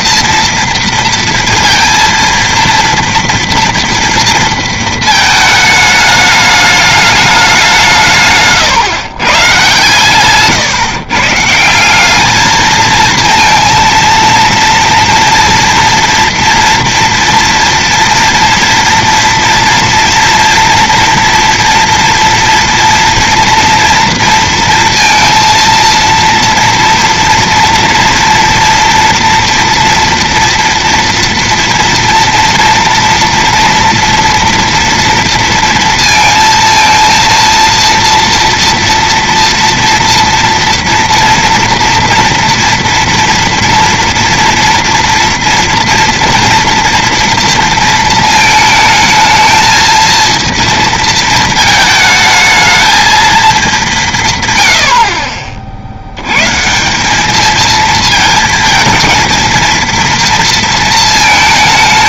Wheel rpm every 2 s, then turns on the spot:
230, 230, 230, 210, 150, 140, 220, 230, 230, 230, 240, 240, 230, 230, 230, 230, 230, 230, 230, 230, 230, 230, 230, 230, 220, 230, 220, 130, 130, 220, 230.
none